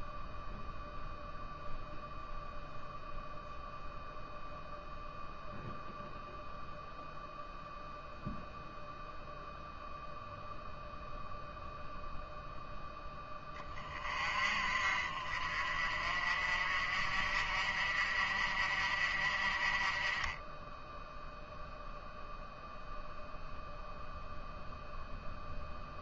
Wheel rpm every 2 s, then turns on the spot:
0, 0, 0, 0, 0, 0, 10, 40, 50, 50, 0, 0, 0.
none